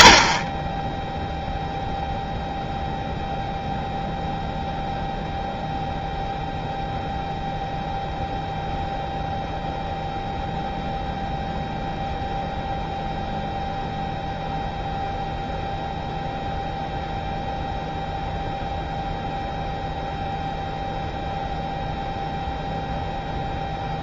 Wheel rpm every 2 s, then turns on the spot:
0, 0, 0, 0, 0, 0, 0, 0, 0, 0, 0, 0.
none